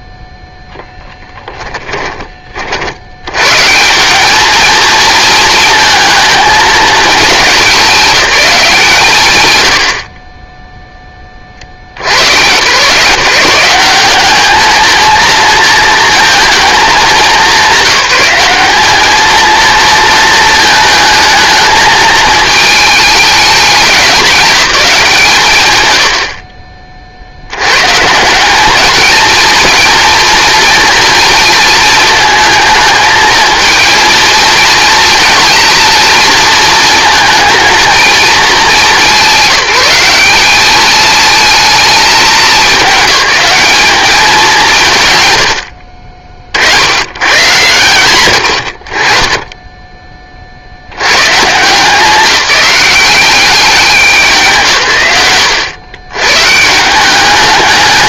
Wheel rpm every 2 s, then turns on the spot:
0, 50, 220, 220, 190, 20, 120, 220, 220, 200, 220, 210, 190, 40, 200, 230, 220, 230, 230, 190, 200, 210, 170, 50, 90, 40, 190, 180, 150.
none